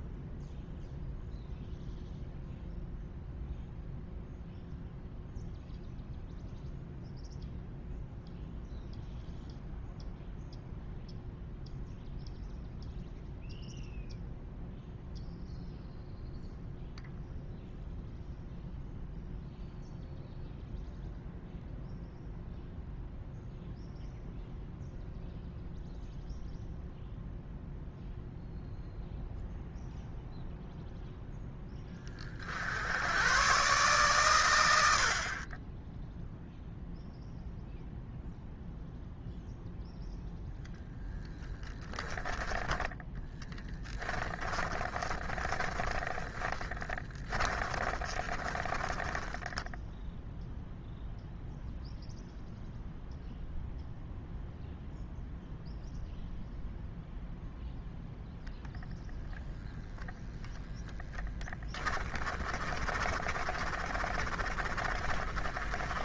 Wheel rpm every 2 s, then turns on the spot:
0, 0, 0, 0, 0, 0, 0, 0, 0, 0, 0, 0, 0, 0, 0, 0, 70, 90, 0, 0, 0, 10, 20, 10, 20, 0, 0, 0, 0, 0, 0, 30, 30.
44-50 62-66